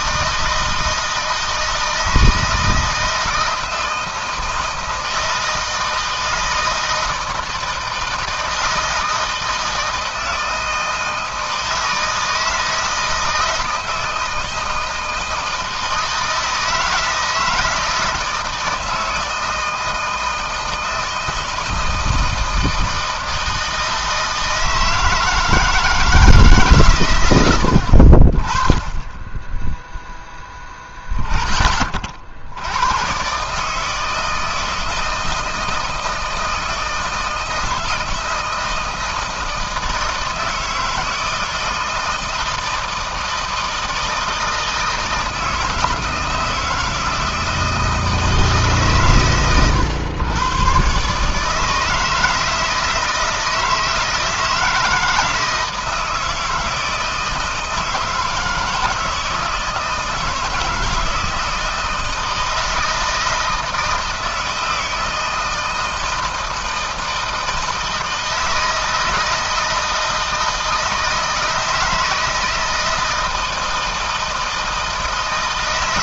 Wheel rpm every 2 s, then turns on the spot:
160, 160, 160, 160, 160, 160, 160, 160, 160, 160, 160, 160, 160, 130, 20, 10, 100, 160, 160, 160, 160, 160, 160, 160, 140, 130, 160, 160, 160, 160, 160, 160, 160, 170, 160, 160, 160, 150.
none